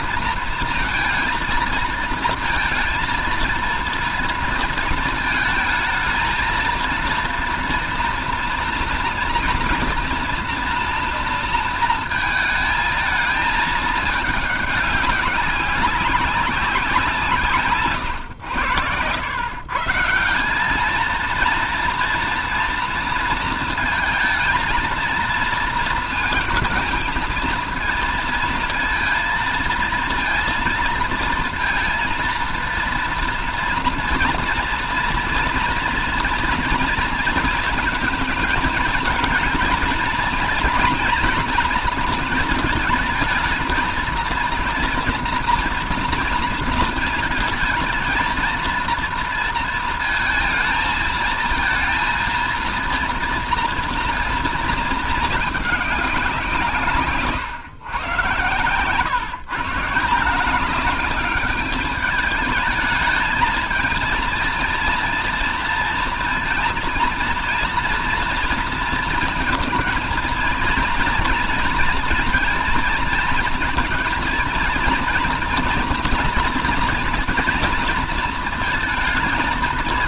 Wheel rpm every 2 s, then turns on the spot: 230, 230, 230, 230, 230, 230, 220, 200, 190, 110, 190, 230, 230, 230, 230, 230, 230, 230, 230, 220, 230, 230, 230, 230, 230, 220, 230, 230, 170, 130, 190, 220, 230, 230, 230, 230, 230, 230, 230, 230.
58-60